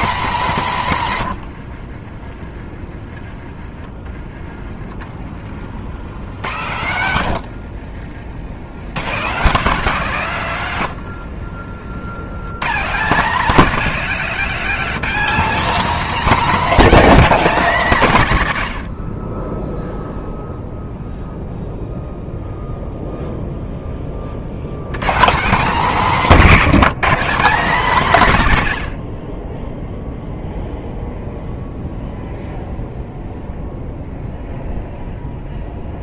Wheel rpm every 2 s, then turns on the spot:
200, 30, 30, 120, 100, 150, 160, 220, 260, 100, 0, 0, 80, 220, 130, 0, 0, 0.
6-8